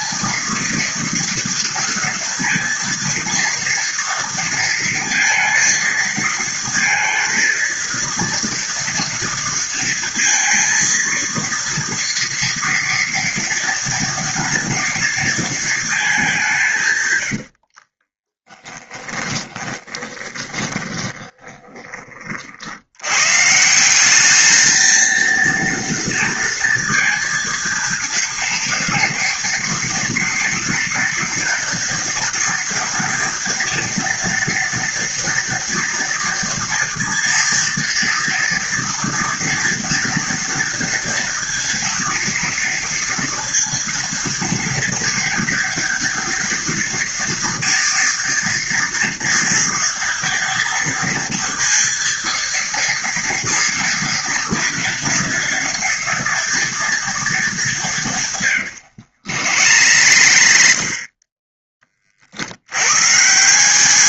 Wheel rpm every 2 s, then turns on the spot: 230, 230, 230, 230, 230, 230, 230, 230, 170, 10, 20, 60, 220, 230, 230, 240, 230, 230, 240, 230, 230, 230, 230, 230, 230, 230, 230, 230, 230, 120, 60, 80.
18-22 58-62